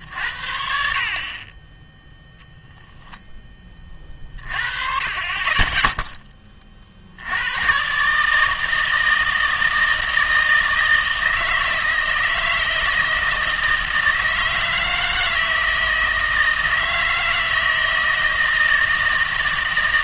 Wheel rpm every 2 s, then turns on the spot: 70, 0, 30, 30, 160, 160, 160, 160, 160, 160.
none